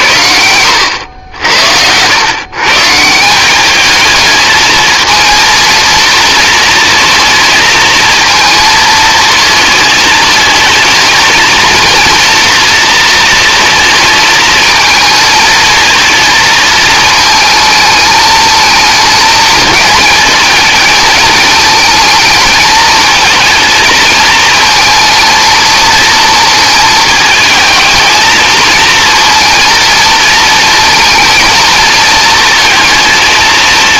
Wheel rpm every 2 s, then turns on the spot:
80, 140, 220, 230, 220, 220, 230, 230, 220, 220, 220, 220, 230, 220, 230, 230, 220.
none